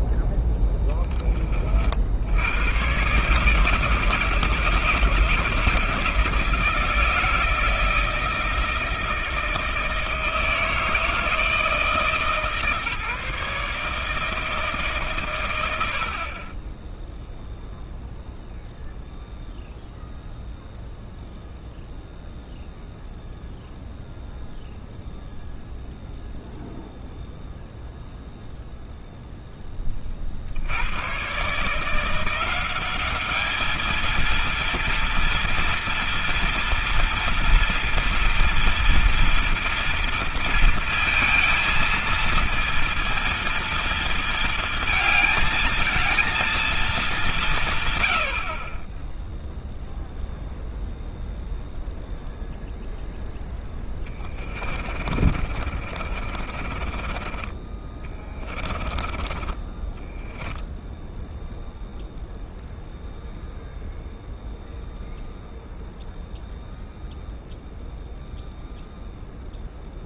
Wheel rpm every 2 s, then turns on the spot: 10, 100, 160, 160, 160, 160, 150, 150, 10, 0, 0, 0, 0, 0, 0, 80, 190, 230, 230, 230, 230, 230, 220, 220, 30, 0, 0, 40, 40, 30, 10, 0, 0, 0, 0.
54-62